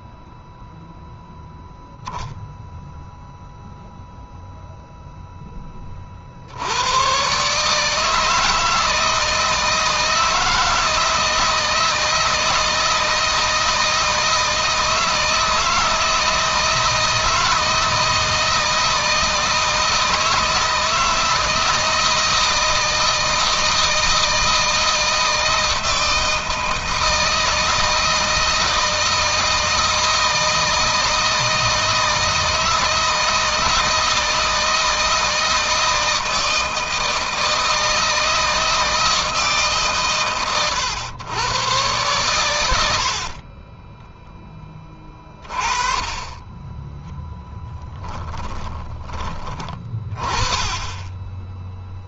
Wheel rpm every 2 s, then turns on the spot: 0, 0, 10, 140, 160, 160, 160, 160, 160, 160, 160, 160, 160, 160, 160, 160, 160, 160, 160, 160, 110, 40, 30, 20, 30, 10.
46-48